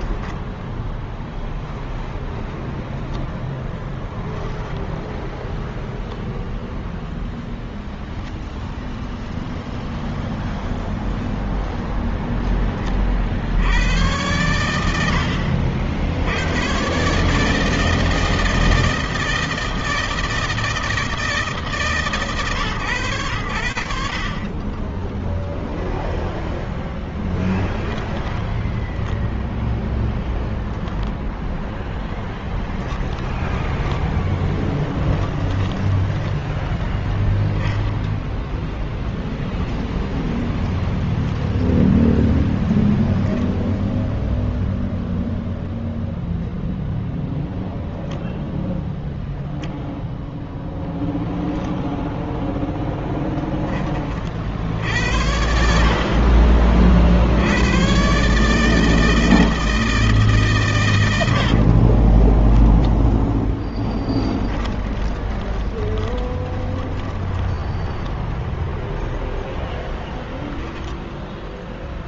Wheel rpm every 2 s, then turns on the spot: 10, 0, 10, 0, 0, 0, 0, 90, 80, 160, 160, 150, 50, 0, 10, 0, 10, 10, 10, 0, 0, 10, 0, 0, 0, 0, 0, 60, 40, 150, 140, 0, 20, 10, 0, 0.
4-6 28-30 32-36 64-68